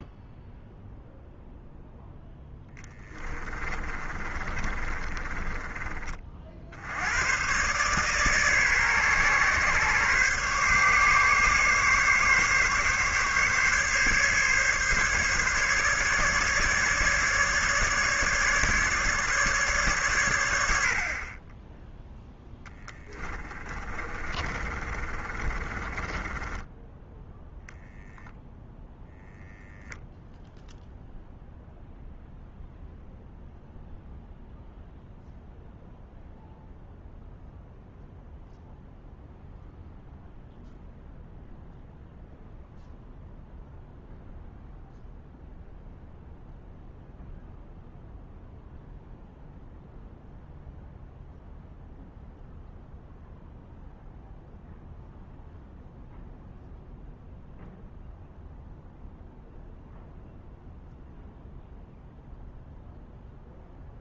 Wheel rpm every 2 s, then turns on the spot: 0, 10, 30, 80, 140, 140, 140, 140, 150, 150, 60, 10, 30, 10, 0, 0, 0, 0, 0, 0, 0, 0, 0, 0, 0, 0, 0, 0, 0, 0, 0, 0.
2-6 22-28